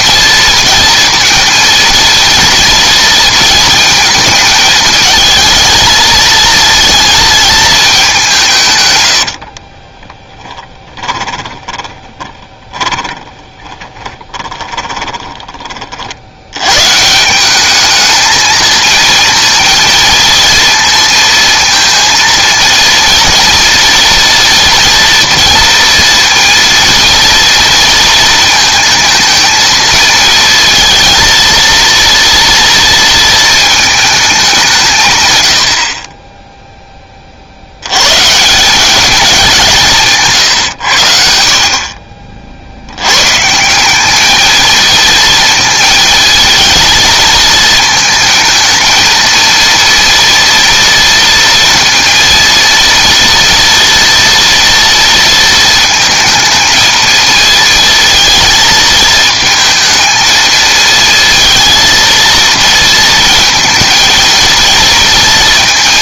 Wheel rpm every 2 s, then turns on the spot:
230, 230, 220, 220, 130, 20, 10, 20, 110, 220, 230, 230, 230, 230, 220, 230, 230, 170, 10, 190, 110, 70, 220, 220, 230, 230, 230, 230, 220, 220, 220, 230, 230.
10-16